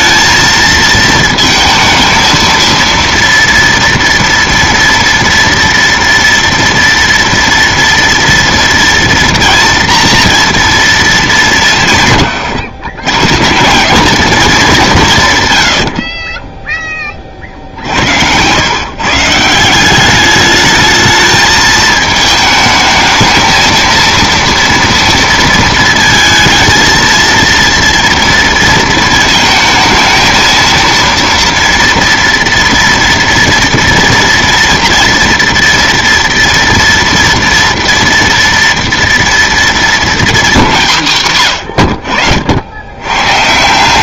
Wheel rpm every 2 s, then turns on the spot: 220, 230, 240, 230, 230, 230, 120, 190, 10, 110, 210, 220, 230, 230, 230, 230, 230, 240, 230, 230, 200, 80.
none